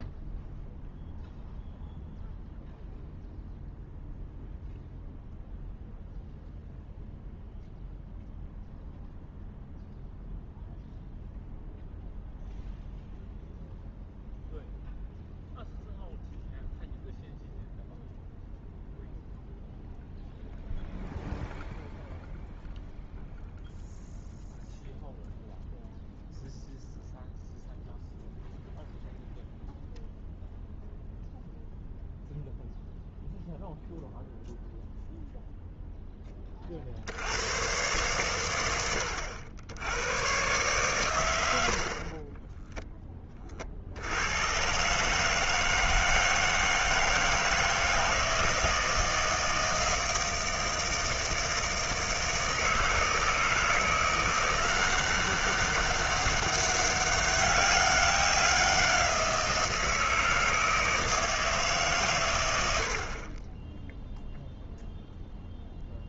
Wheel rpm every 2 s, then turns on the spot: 0, 0, 0, 0, 0, 0, 0, 0, 0, 0, 0, 0, 0, 0, 0, 0, 0, 0, 30, 100, 120, 10, 120, 160, 160, 160, 160, 180, 200, 190, 160, 100, 0.
none